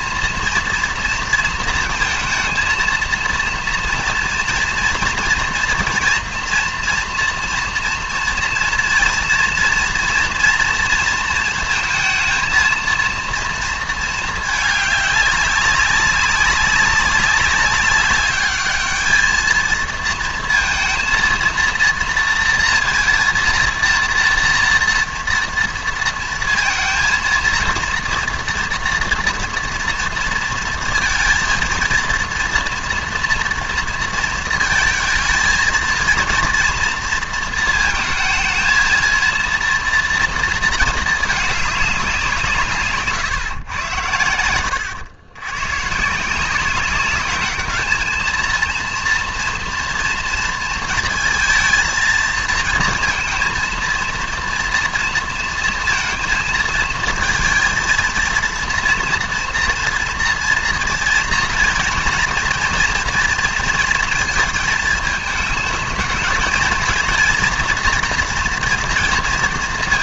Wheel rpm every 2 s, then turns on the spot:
230, 230, 230, 230, 230, 230, 230, 210, 200, 210, 230, 230, 230, 220, 230, 230, 230, 230, 230, 230, 230, 160, 100, 190, 230, 230, 220, 230, 220, 230, 230, 230, 220, 230, 230.
44-46